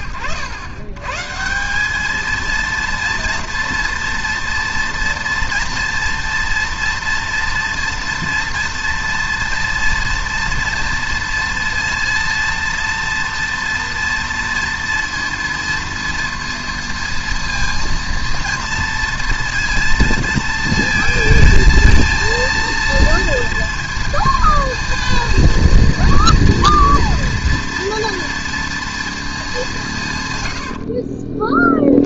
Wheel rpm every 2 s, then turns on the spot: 110, 230, 230, 230, 230, 230, 230, 230, 230, 230, 230, 230, 230, 230, 230, 80.
30-32